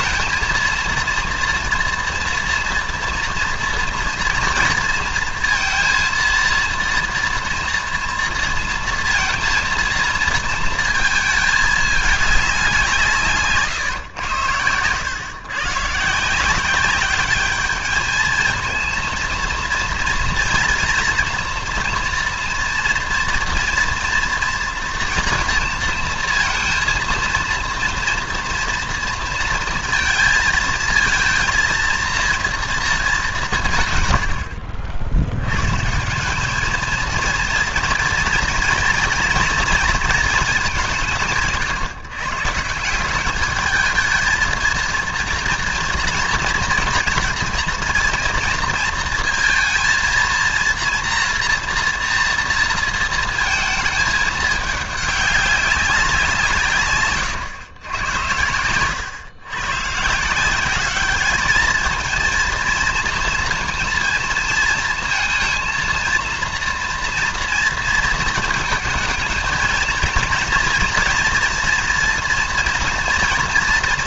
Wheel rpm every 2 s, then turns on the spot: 230, 230, 230, 230, 230, 230, 190, 110, 180, 230, 230, 230, 230, 230, 230, 220, 230, 70, 230, 240, 190, 180, 230, 230, 230, 230, 230, 210, 140, 110, 200, 230, 230, 230, 220, 240, 230.
none